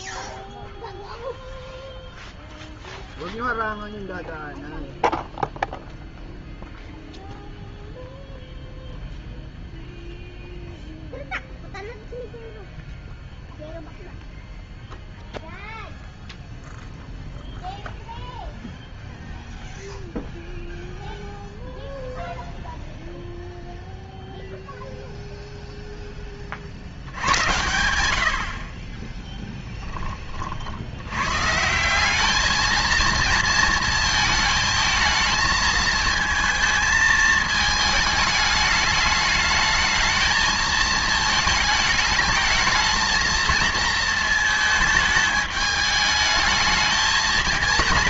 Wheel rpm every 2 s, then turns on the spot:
0, 0, 0, 0, 0, 0, 0, 0, 0, 0, 0, 0, 0, 60, 30, 60, 220, 220, 220, 210, 220, 220, 220, 220.
28-30